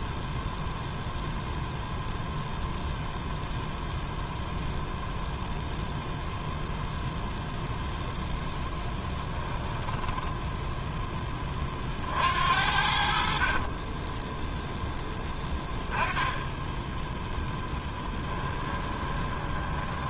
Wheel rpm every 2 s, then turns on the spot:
0, 0, 0, 0, 10, 0, 60, 10, 10, 20.
8-10 18-20